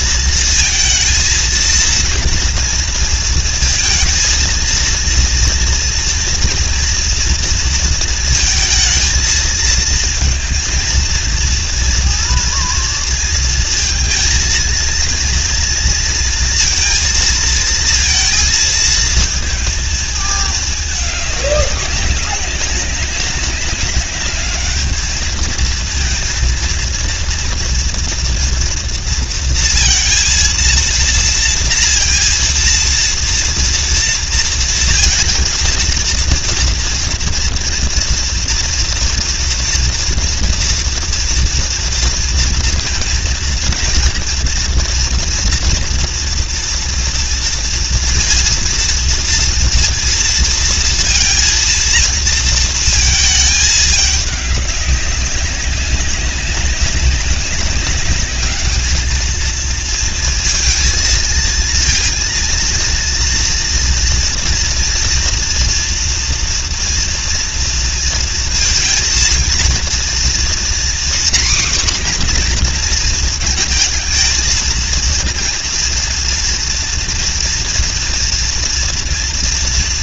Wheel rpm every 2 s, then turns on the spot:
230, 230, 230, 230, 220, 230, 230, 230, 230, 230, 210, 200, 210, 230, 230, 230, 230, 230, 230, 230, 230, 230, 230, 230, 230, 230, 230, 200, 190, 210, 220, 230, 230, 230, 230, 250, 240, 230, 230, 230.
none